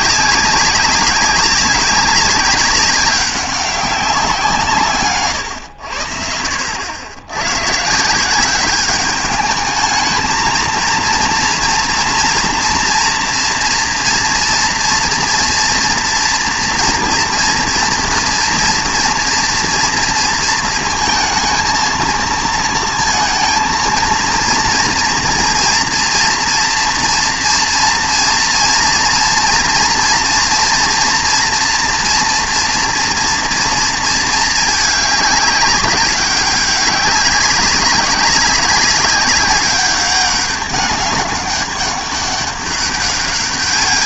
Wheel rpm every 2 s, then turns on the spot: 190, 190, 160, 70, 200, 230, 230, 230, 230, 230, 220, 230, 230, 240, 230, 230, 240, 220, 200, 200, 200, 200.
none